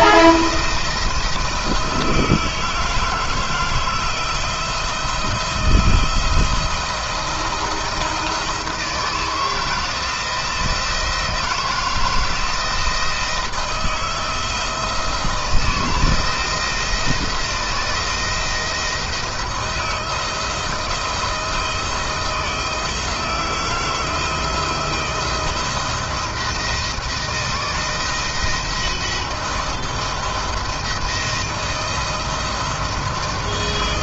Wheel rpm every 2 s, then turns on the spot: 170, 160, 170, 170, 160, 170, 160, 160, 170, 170, 170, 160, 170, 170, 170, 170, 170.
none